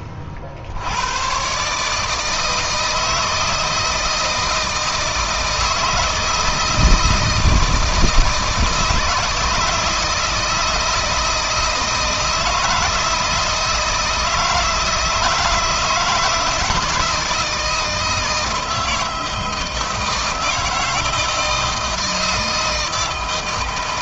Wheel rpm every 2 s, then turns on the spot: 50, 160, 160, 160, 160, 160, 160, 160, 160, 160, 160, 150.
none